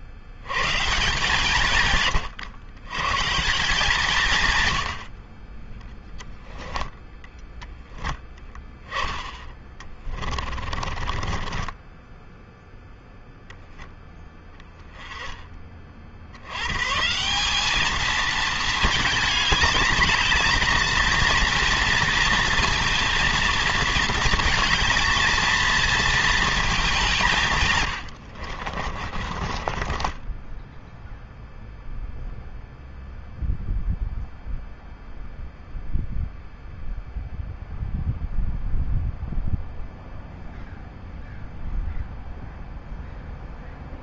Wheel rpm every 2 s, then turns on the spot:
150, 140, 50, 10, 10, 30, 0, 20, 170, 210, 230, 230, 230, 160, 30, 0, 0, 0, 0, 0, 0, 0.
8-12 28-30